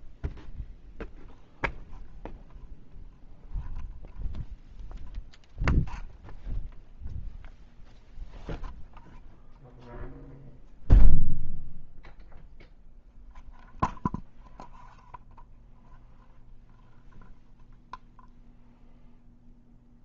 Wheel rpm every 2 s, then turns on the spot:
0, 0, 0, 0, 0, 0, 0, 0, 0, 0.
none